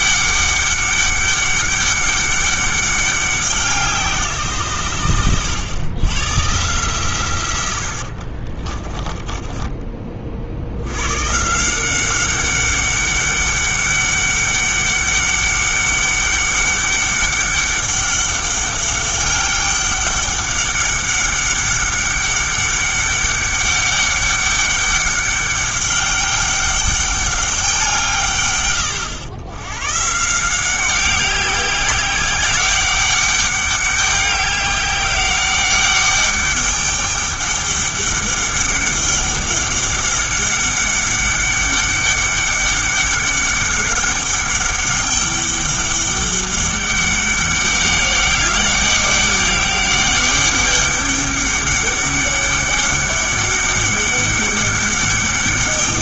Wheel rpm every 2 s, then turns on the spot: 200, 200, 130, 130, 30, 70, 200, 200, 200, 200, 200, 200, 200, 200, 120, 180, 200, 200, 200, 200, 200, 200, 200, 200, 200, 200, 200, 200.
8-10